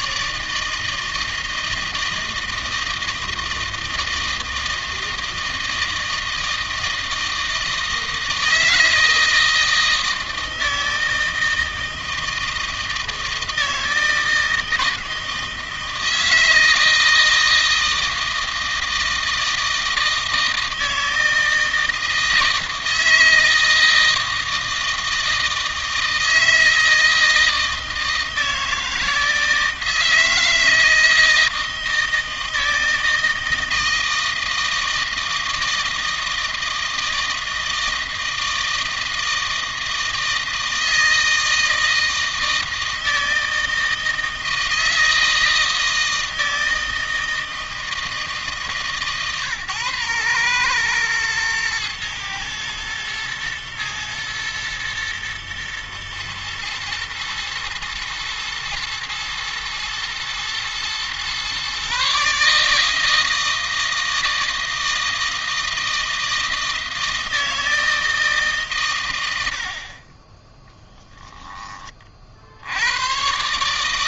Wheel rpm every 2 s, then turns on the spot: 160, 160, 160, 160, 160, 160, 160, 160, 160, 160, 160, 160, 160, 160, 160, 160, 160, 160, 160, 160, 160, 160, 160, 160, 130, 110, 110, 110, 110, 120, 120, 160, 160, 160, 120, 10, 90.
none